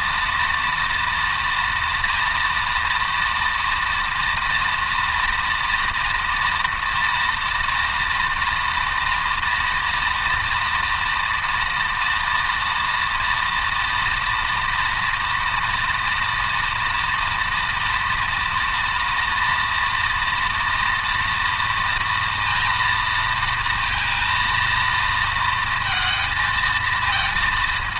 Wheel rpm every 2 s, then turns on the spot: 230, 230, 230, 230, 230, 230, 230, 230, 230, 240, 230, 230, 230, 230.
none